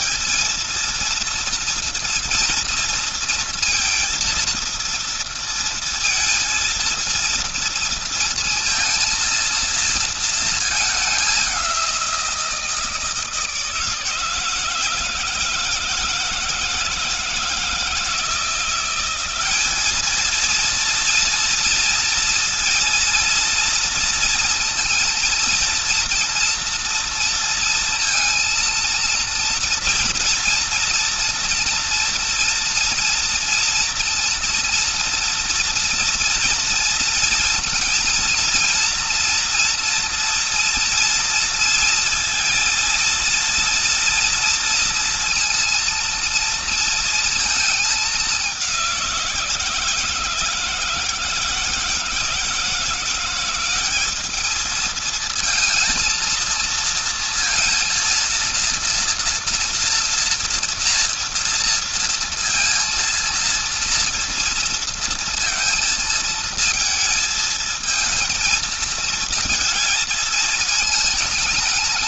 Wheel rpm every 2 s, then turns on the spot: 230, 230, 230, 230, 230, 210, 160, 160, 160, 180, 230, 230, 230, 230, 230, 230, 230, 230, 230, 230, 230, 230, 230, 230, 170, 160, 170, 220, 230, 230, 230, 230, 230, 220, 220, 220.
none